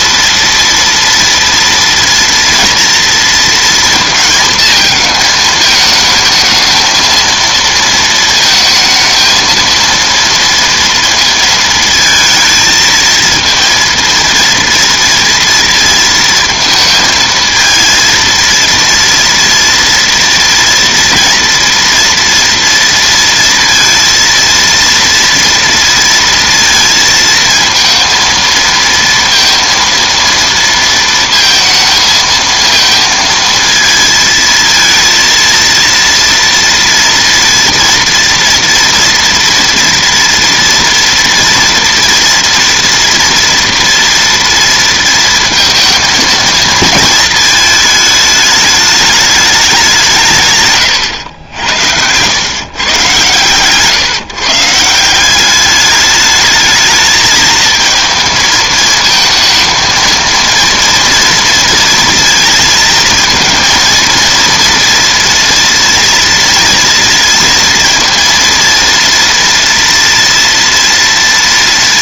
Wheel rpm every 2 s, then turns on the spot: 240, 230, 220, 220, 220, 230, 220, 230, 230, 230, 230, 230, 230, 230, 230, 230, 220, 230, 230, 230, 230, 230, 230, 230, 210, 130, 130, 160, 210, 220, 230, 230, 230, 230, 230, 230.
none